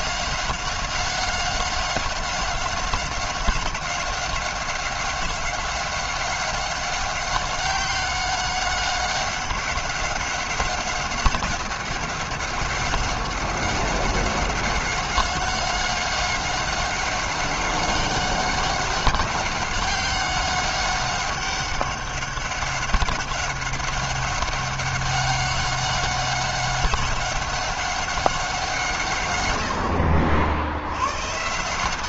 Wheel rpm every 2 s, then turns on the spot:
190, 190, 190, 190, 190, 190, 190, 190, 190, 190, 200, 190, 190, 190, 130, 120.
none